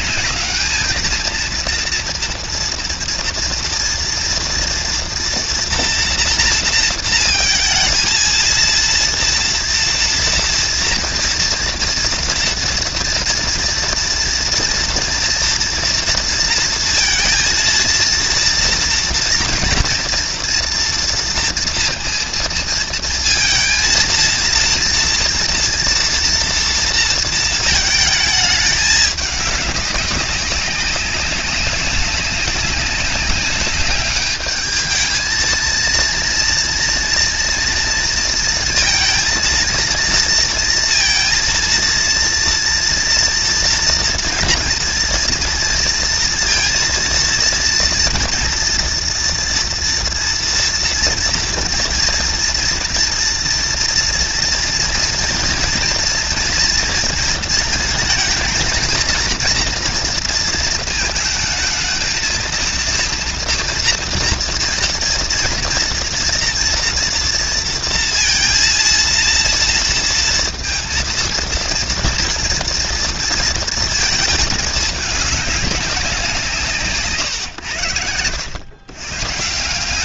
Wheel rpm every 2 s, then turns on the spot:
210, 230, 230, 230, 230, 240, 240, 240, 230, 230, 230, 230, 230, 230, 210, 200, 200, 210, 230, 230, 230, 230, 230, 230, 230, 230, 230, 230, 230, 230, 230, 230, 230, 230, 230, 230, 230, 210, 150, 110.
none